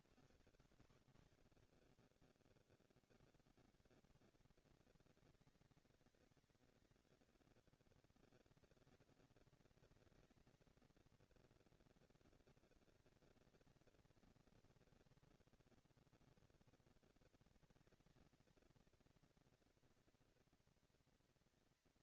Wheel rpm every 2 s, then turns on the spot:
150, 60, 180, 200, 210, 220, 230, 230, 230, 220, 230.
none